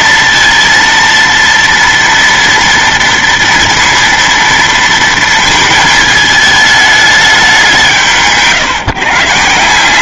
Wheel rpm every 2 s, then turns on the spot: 230, 230, 230, 220, 160.
none